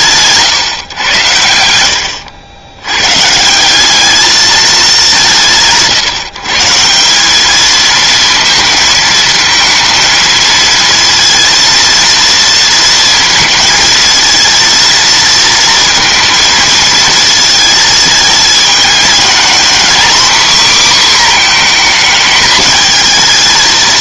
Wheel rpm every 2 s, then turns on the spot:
150, 90, 210, 160, 230, 230, 230, 230, 230, 220, 260, 220.
none